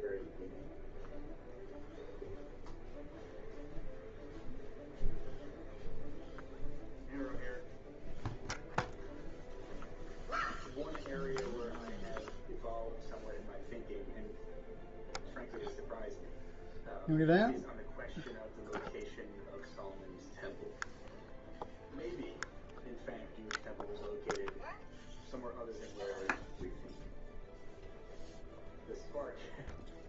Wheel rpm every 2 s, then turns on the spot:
0, 0, 0, 0, 0, 0, 0, 0, 0, 0, 0, 0, 0, 0, 0.
none